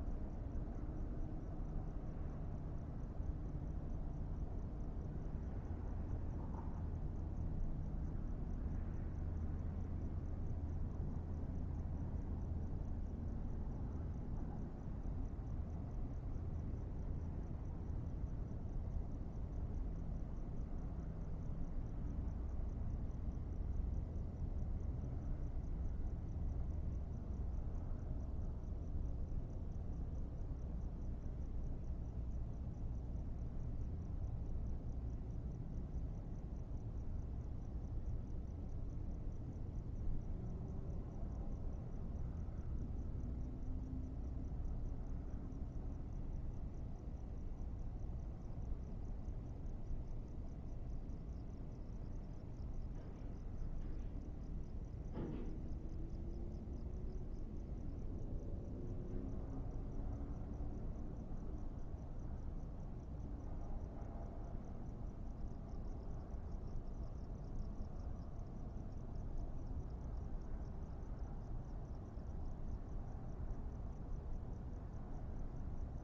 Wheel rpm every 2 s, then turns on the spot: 0, 0, 0, 0, 0, 0, 0, 0, 0, 0, 0, 0, 0, 0, 0, 0, 0, 0, 0, 0, 0, 0, 0, 0, 0, 0, 0, 0, 0, 0, 0, 0, 0, 0, 0, 0, 0, 0.
none